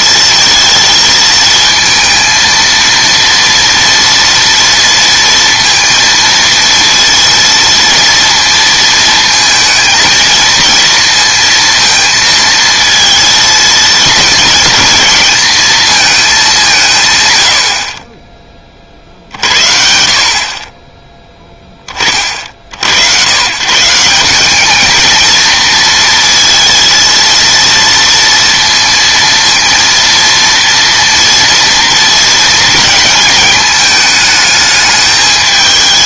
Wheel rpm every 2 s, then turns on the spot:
220, 230, 230, 230, 230, 230, 220, 220, 160, 30, 30, 60, 210, 230, 230, 230, 230, 210.
none